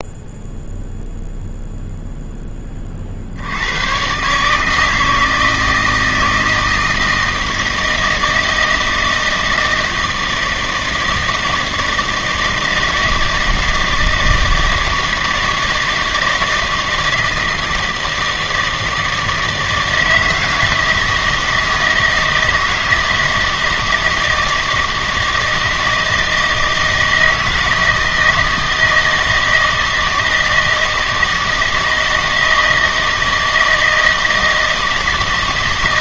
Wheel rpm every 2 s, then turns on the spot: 0, 20, 160, 160, 160, 160, 160, 160, 160, 160, 160, 160, 160, 160, 160, 160, 160, 160.
none